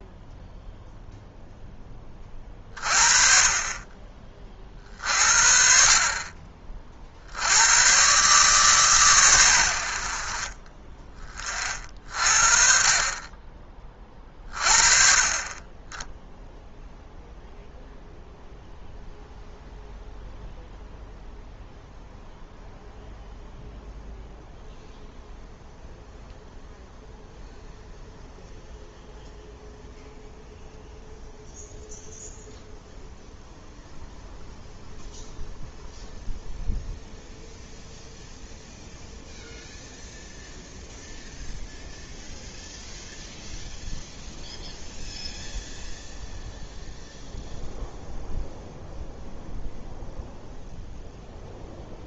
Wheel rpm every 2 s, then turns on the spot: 0, 40, 40, 40, 130, 30, 40, 40, 0, 0, 0, 0, 0, 0, 0, 0, 0, 0, 0, 0, 0, 0, 0, 0, 0, 0.
none